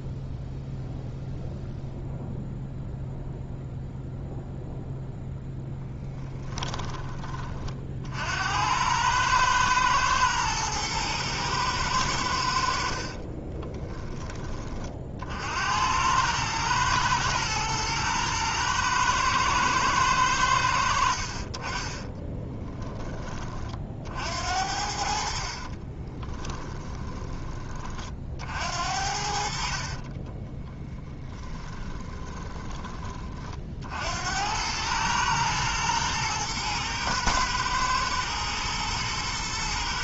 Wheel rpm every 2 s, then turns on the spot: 0, 0, 0, 20, 100, 110, 60, 40, 110, 110, 80, 10, 50, 20, 60, 20, 30, 100, 110, 110.
12-14 26-28 30-32